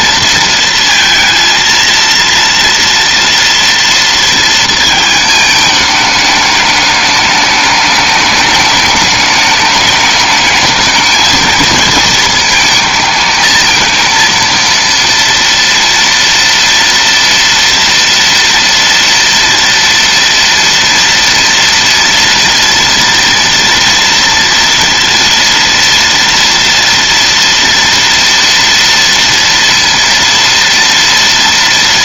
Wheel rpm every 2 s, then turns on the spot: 230, 230, 230, 210, 210, 220, 220, 230, 230, 230, 230, 240, 230, 230, 230, 230.
none